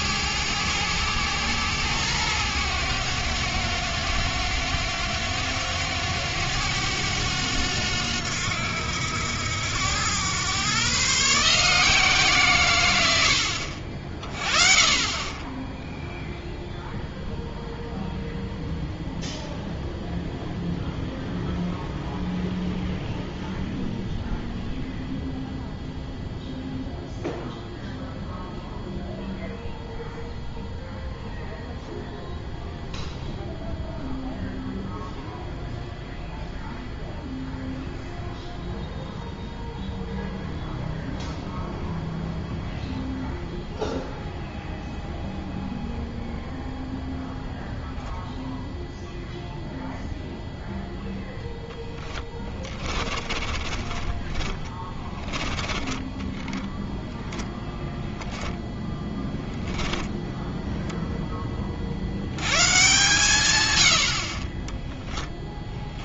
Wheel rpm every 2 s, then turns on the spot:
110, 100, 90, 100, 90, 130, 130, 30, 0, 0, 0, 0, 0, 0, 0, 0, 0, 0, 0, 0, 0, 0, 0, 0, 0, 0, 30, 20, 10, 10, 10, 140, 20.
52-58